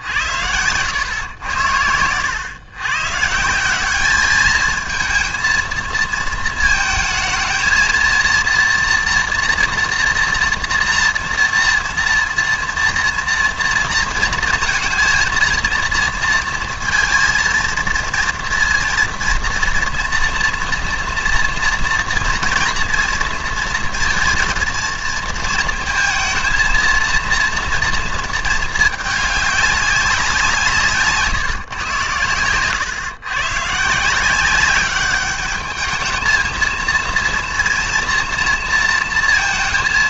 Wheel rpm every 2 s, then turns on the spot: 100, 110, 220, 220, 230, 230, 230, 230, 230, 230, 230, 230, 230, 230, 220, 160, 110, 190, 230, 230.
none